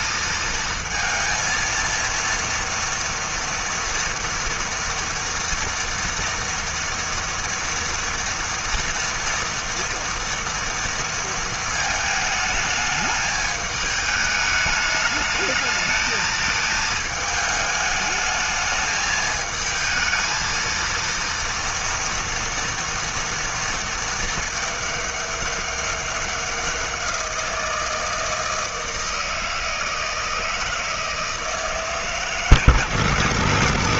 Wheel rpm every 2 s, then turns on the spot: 220, 230, 230, 240, 230, 230, 220, 210, 220, 210, 220, 230, 220, 190, 160, 160, 150.
none